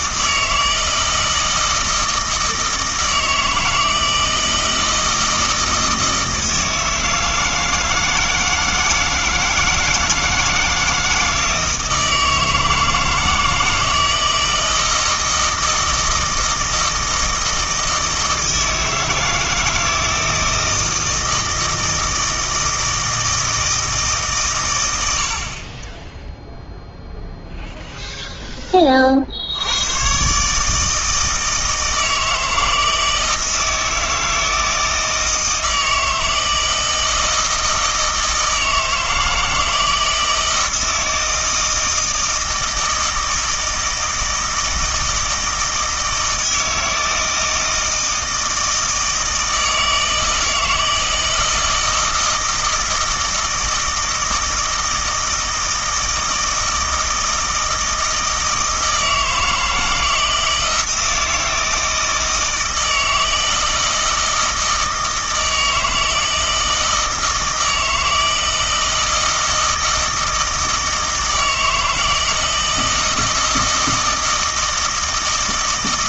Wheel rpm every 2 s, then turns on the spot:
160, 160, 160, 160, 160, 160, 160, 160, 160, 160, 160, 160, 120, 0, 10, 150, 160, 160, 160, 160, 160, 160, 160, 160, 160, 160, 160, 160, 160, 160, 160, 160, 160, 160, 160, 160, 160, 160.
none